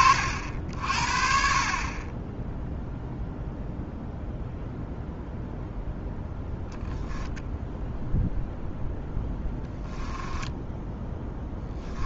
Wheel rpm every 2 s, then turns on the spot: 50, 0, 0, 0, 0, 10.
10-12